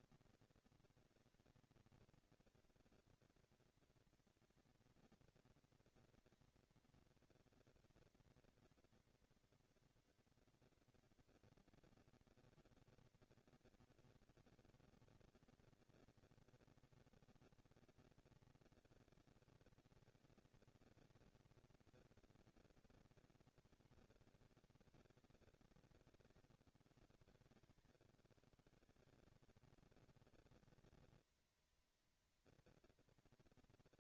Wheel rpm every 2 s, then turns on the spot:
230, 230, 230, 230, 230, 240, 240, 230, 230, 220, 220, 230, 200, 130, 160, 220, 230.
none